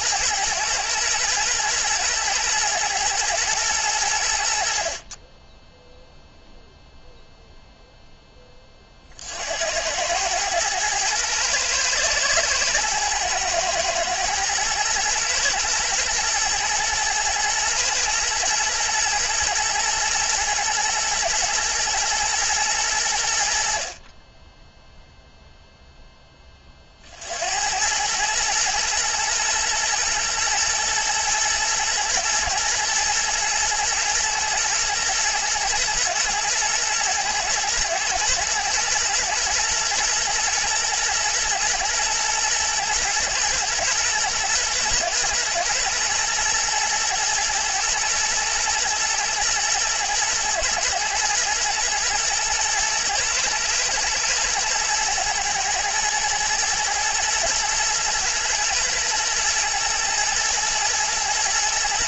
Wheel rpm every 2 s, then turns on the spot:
110, 110, 40, 0, 40, 110, 120, 120, 120, 110, 110, 90, 0, 50, 120, 110, 110, 120, 110, 120, 110, 120, 120, 120, 110, 120, 120, 120, 110, 110, 110.
none